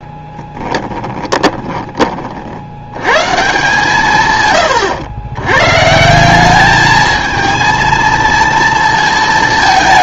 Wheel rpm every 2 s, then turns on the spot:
10, 80, 130, 210, 230.
0-2